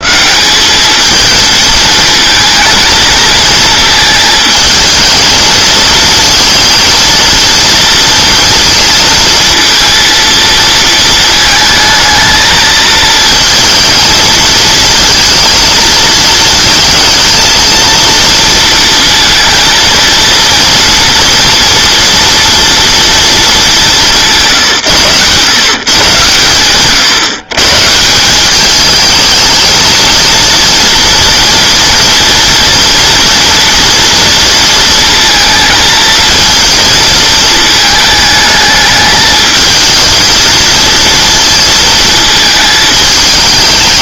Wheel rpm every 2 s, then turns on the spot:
210, 230, 220, 230, 230, 220, 220, 220, 220, 230, 230, 230, 140, 120, 210, 230, 240, 230, 220, 220, 230, 220.
none